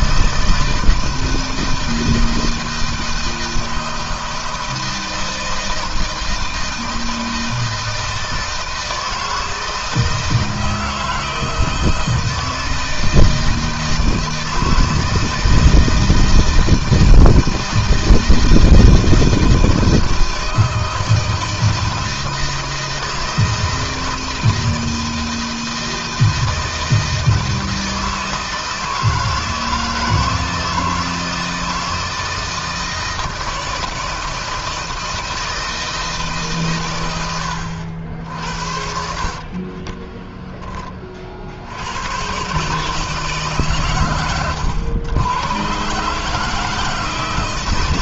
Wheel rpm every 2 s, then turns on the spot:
160, 160, 160, 160, 160, 160, 160, 160, 160, 160, 160, 160, 160, 160, 160, 160, 160, 160, 110, 60, 30, 150, 110, 160.
38-40